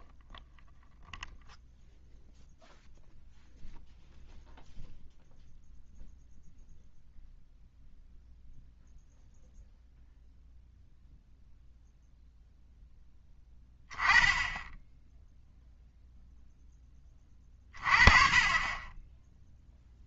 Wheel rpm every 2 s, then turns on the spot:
0, 0, 0, 0, 0, 0, 0, 10, 10, 20.
none